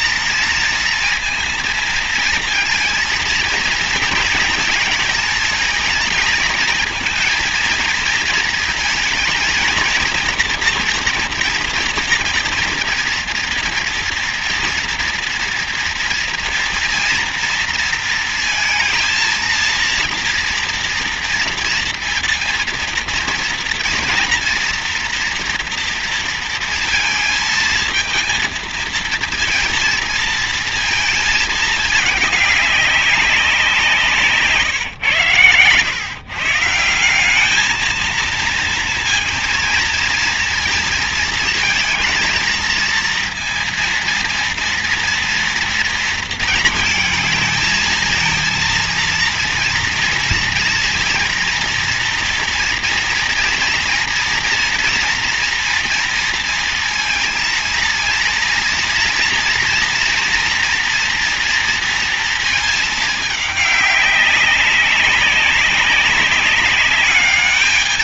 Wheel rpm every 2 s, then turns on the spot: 230, 230, 230, 220, 230, 230, 230, 230, 230, 230, 230, 230, 240, 230, 220, 230, 200, 150, 140, 220, 230, 230, 230, 230, 220, 230, 240, 230, 230, 230, 240, 230, 200, 200.
none